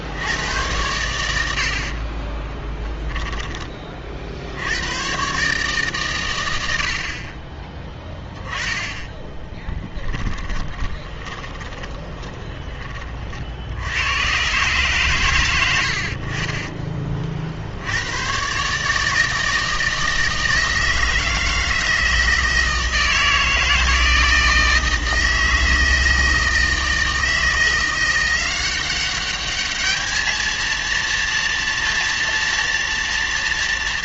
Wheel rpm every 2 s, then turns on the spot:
100, 10, 100, 80, 10, 20, 30, 130, 30, 140, 160, 160, 160, 160, 190, 230, 230.
2-4 10-12